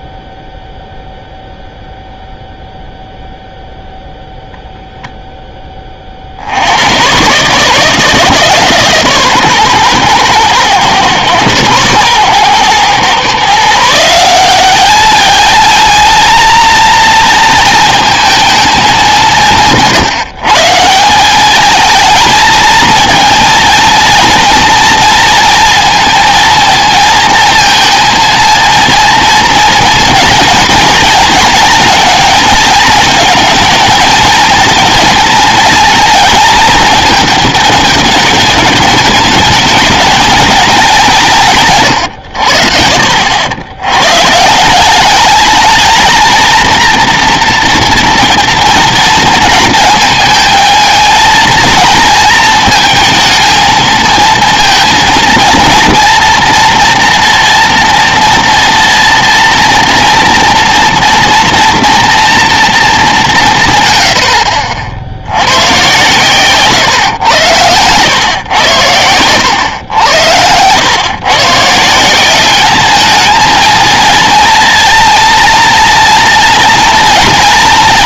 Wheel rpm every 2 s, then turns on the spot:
0, 0, 0, 90, 150, 120, 120, 200, 230, 220, 160, 220, 230, 230, 230, 230, 230, 230, 220, 210, 210, 60, 170, 230, 240, 220, 230, 230, 230, 230, 230, 220, 50, 130, 110, 100, 200, 240, 230.
none